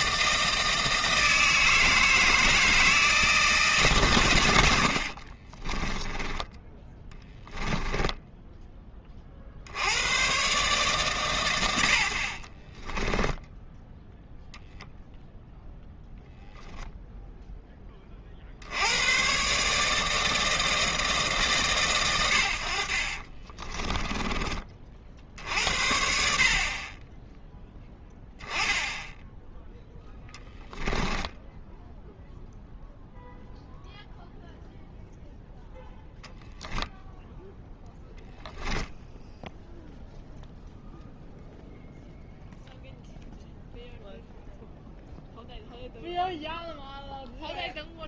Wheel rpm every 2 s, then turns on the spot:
160, 160, 90, 10, 10, 130, 30, 0, 0, 60, 160, 70, 30, 50, 10, 10, 0, 0, 10, 0, 0, 0, 0, 0.
6-8 12-14 30-32